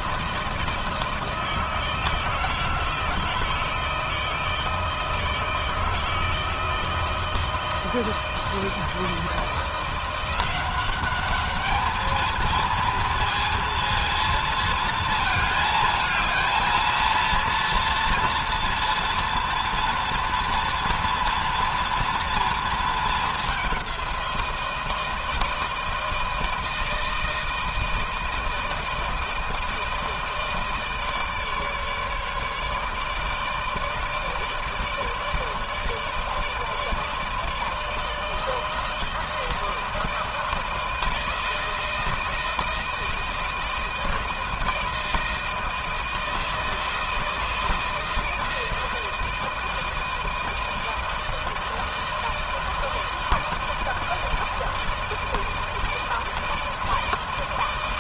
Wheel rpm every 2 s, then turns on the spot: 160, 160, 160, 160, 160, 180, 220, 230, 220, 230, 230, 230, 180, 160, 160, 160, 150, 160, 150, 160, 160, 160, 160, 160, 160, 160, 160, 160, 160.
none